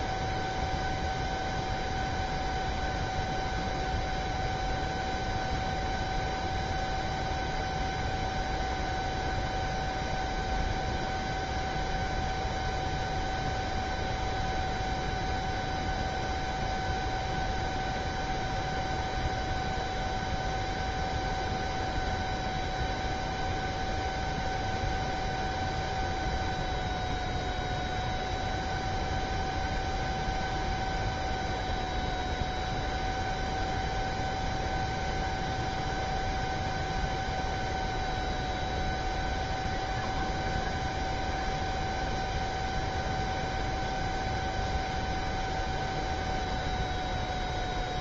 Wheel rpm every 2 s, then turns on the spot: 0, 0, 0, 0, 0, 0, 0, 0, 0, 0, 0, 0, 0, 0, 0, 0, 0, 0, 0, 0, 0, 0, 0, 0.
none